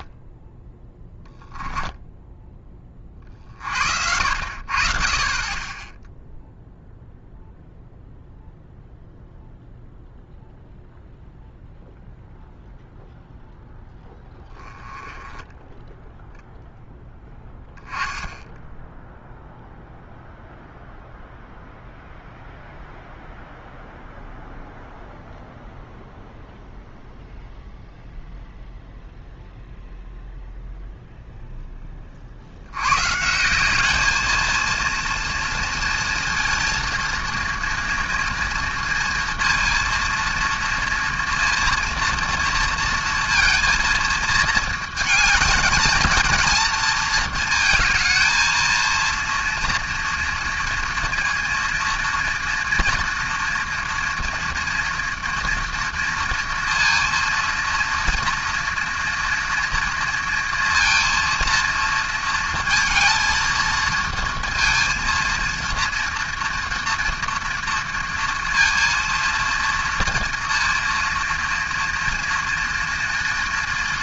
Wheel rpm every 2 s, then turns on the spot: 10, 20, 50, 0, 0, 0, 0, 10, 0, 0, 0, 0, 0, 0, 0, 0, 100, 230, 230, 230, 230, 230, 220, 220, 230, 230, 230, 230, 230, 230, 230, 230, 230, 230, 230, 230, 230.
none